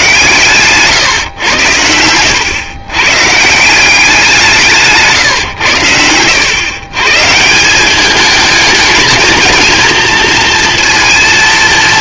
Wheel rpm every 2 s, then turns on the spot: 130, 100, 170, 100, 220, 230.
none